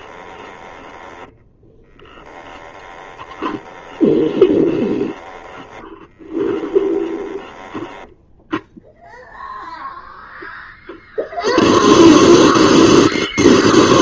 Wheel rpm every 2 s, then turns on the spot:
10, 20, 10, 20, 0, 0, 0.
0-8